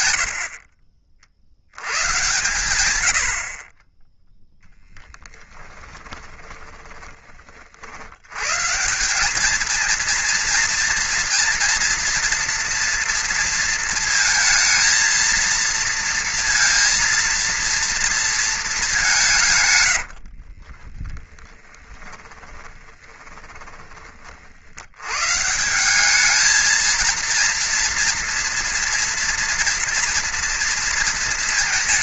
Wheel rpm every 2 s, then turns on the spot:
50, 110, 10, 10, 150, 230, 230, 230, 230, 210, 20, 20, 80, 220, 230, 230.
6-8 20-24